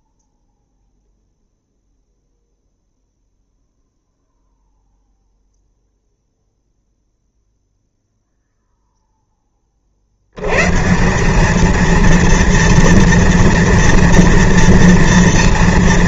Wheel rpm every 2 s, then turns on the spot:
0, 0, 0, 0, 0, 130, 230, 230.
none